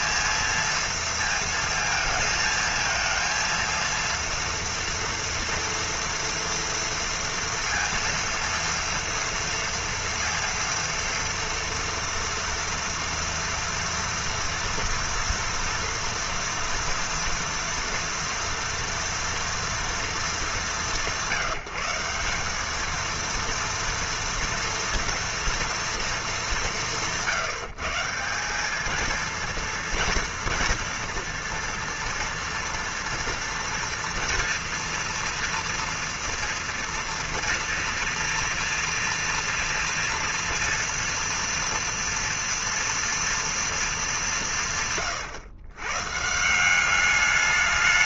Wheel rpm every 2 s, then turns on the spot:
230, 230, 230, 230, 230, 230, 230, 230, 230, 230, 190, 210, 230, 200, 200, 230, 230, 230, 240, 230, 230, 230, 170, 190.
none